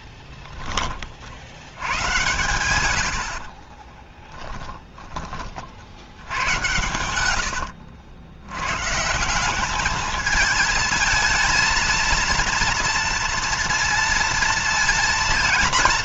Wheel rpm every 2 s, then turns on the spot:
30, 100, 20, 80, 130, 220, 230, 230.
none